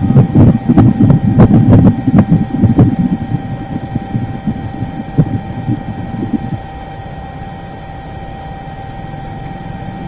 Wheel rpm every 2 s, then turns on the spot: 0, 0, 0, 0, 0.
none